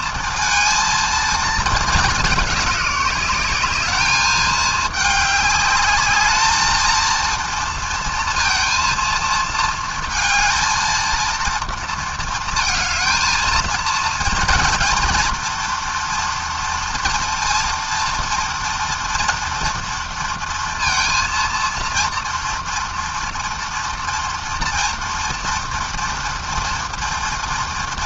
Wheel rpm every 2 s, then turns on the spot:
220, 200, 210, 230, 230, 230, 220, 230, 230, 240, 230, 230, 230, 240.
none